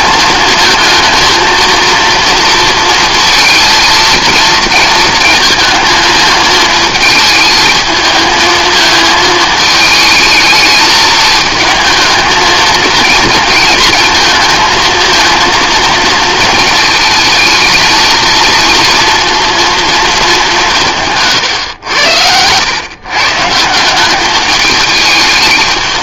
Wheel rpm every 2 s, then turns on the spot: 220, 230, 230, 220, 220, 220, 230, 230, 230, 230, 200, 110, 210.
none